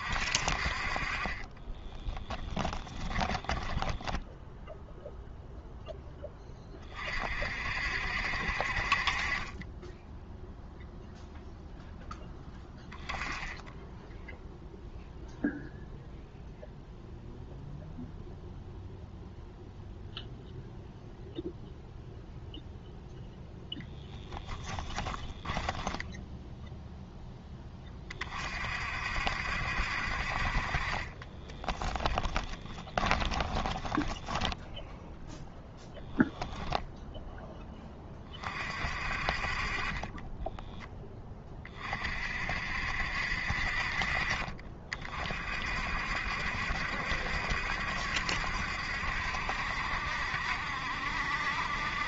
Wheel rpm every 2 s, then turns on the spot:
40, 10, 10, 30, 50, 0, 10, 0, 0, 0, 0, 0, 10, 0, 50, 40, 10, 0, 10, 40, 10, 60, 40, 70, 70, 60.
2-4 24-26 30-34 36-38